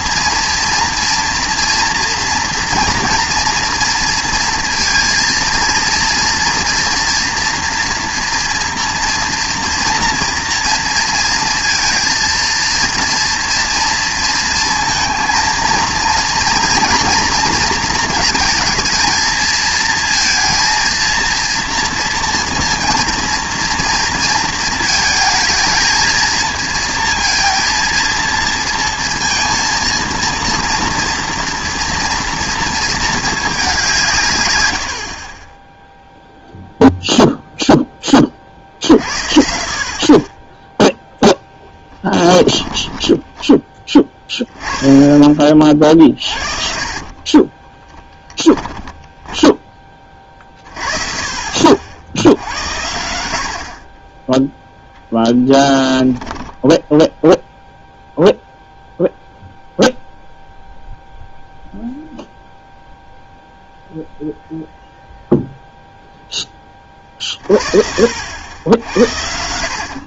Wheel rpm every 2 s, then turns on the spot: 230, 230, 230, 230, 240, 230, 230, 230, 230, 220, 230, 230, 220, 230, 230, 230, 230, 90, 0, 50, 10, 10, 10, 50, 10, 50, 80, 0, 10, 0, 0, 0, 0, 20, 70.
46-50 56-58